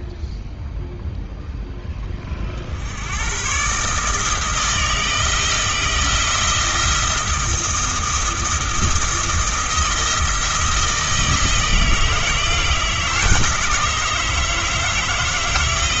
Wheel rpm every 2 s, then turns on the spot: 0, 70, 160, 170, 170, 170, 160, 160.
none